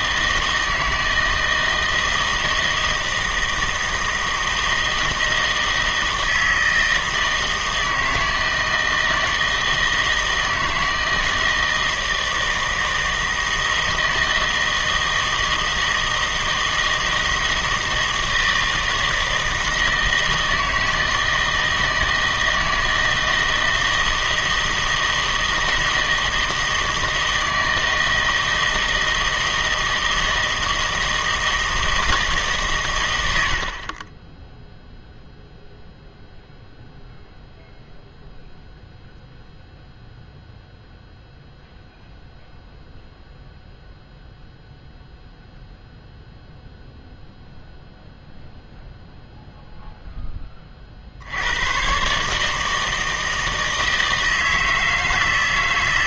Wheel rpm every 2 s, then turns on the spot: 160, 160, 160, 160, 160, 160, 160, 160, 160, 160, 160, 160, 160, 160, 160, 160, 150, 10, 0, 0, 0, 0, 0, 0, 0, 30, 160, 160.
none